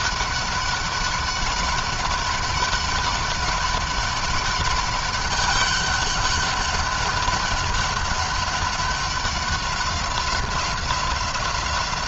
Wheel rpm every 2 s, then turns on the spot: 200, 200, 200, 200, 200, 190.
none